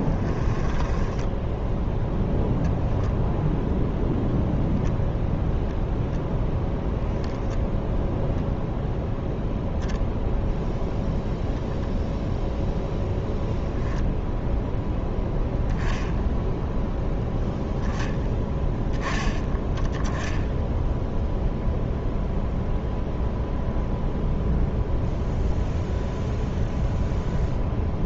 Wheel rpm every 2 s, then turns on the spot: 20, 0, 0, 0, 0, 0, 0, 0, 0, 10, 0, 0, 0, 0.
0-2